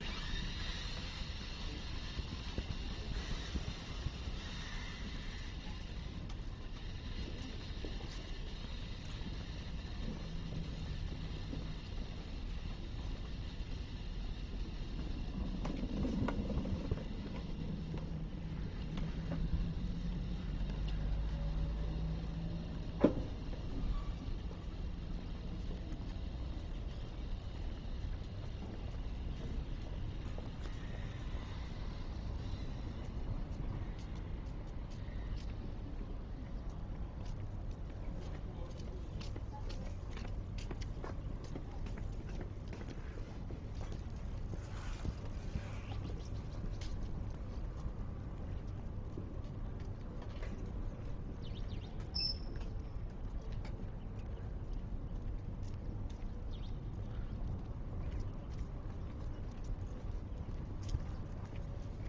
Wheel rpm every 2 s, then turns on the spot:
0, 0, 0, 0, 0, 0, 0, 0, 0, 0, 0, 0, 0, 0, 0, 0, 0, 0, 0, 0, 0, 0, 0, 0, 0, 0, 0, 0, 0, 0, 0.
none